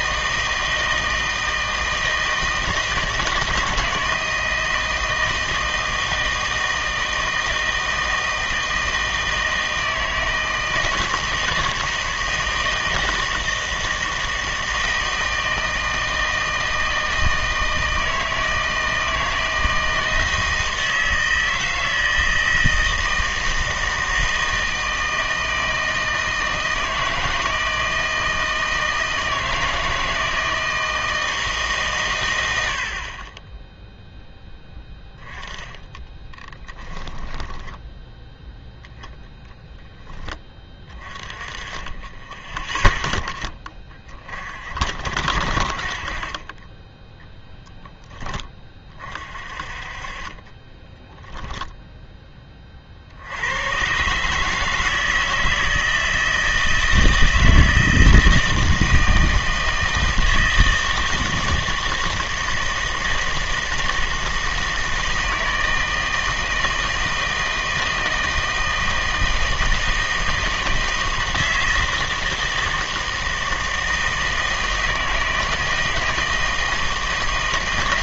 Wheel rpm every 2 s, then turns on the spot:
160, 160, 160, 160, 160, 160, 160, 160, 160, 160, 160, 160, 160, 160, 160, 160, 90, 10, 10, 0, 20, 20, 50, 20, 20, 20, 30, 160, 160, 160, 160, 160, 160, 160, 160, 160, 160, 160, 160.
36-38 50-52